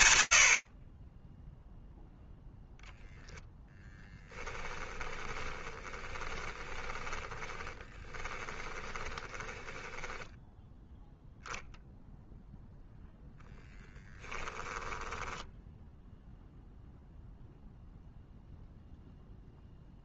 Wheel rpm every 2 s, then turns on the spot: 40, 0, 10, 20, 10, 0, 0, 10, 0, 0.
4-10 14-16